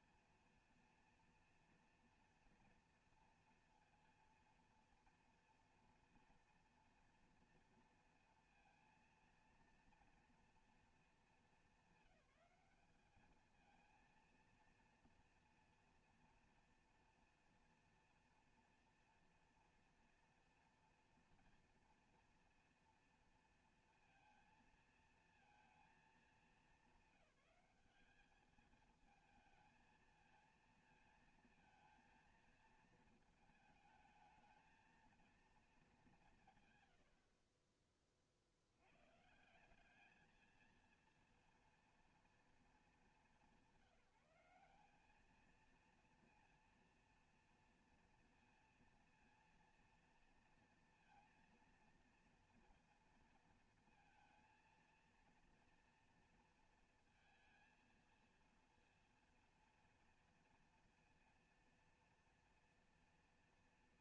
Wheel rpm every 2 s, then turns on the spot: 230, 240, 230, 230, 230, 230, 200, 230, 240, 230, 240, 230, 230, 220, 220, 230, 230, 220, 140, 70, 220, 230, 190, 230, 230, 230, 230, 230, 230, 230, 230, 230.
none